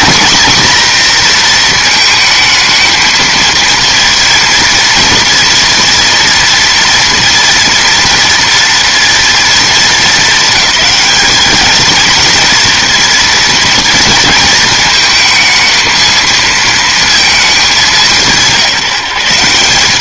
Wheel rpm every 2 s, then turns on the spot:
250, 220, 230, 230, 230, 200, 230, 220, 230, 160.
none